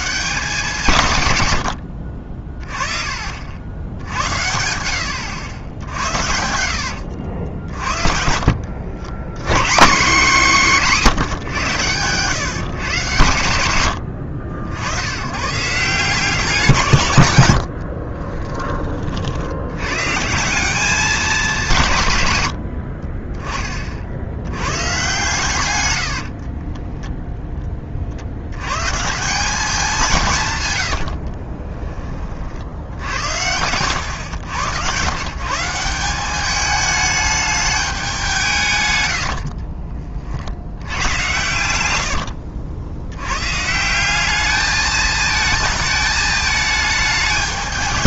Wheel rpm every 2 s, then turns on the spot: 190, 30, 90, 70, 60, 190, 140, 80, 160, 20, 180, 100, 100, 30, 80, 140, 60, 100, 200, 150, 70, 70, 210, 220.
2-8 26-28 42-44